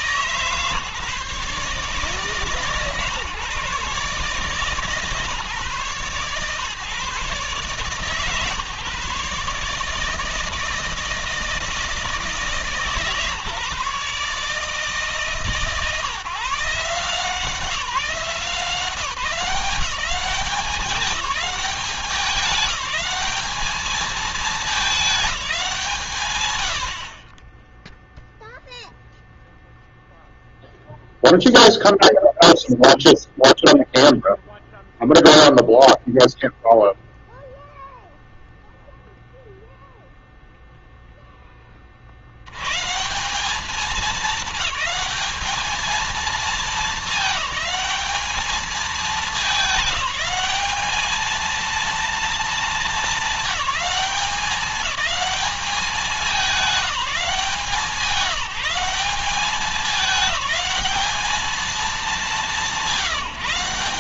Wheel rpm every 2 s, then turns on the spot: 140, 140, 150, 130, 140, 160, 160, 150, 150, 170, 200, 190, 220, 110, 0, 0, 0, 0, 0, 0, 0, 110, 210, 210, 210, 210, 230, 200, 200, 190, 210, 190.
none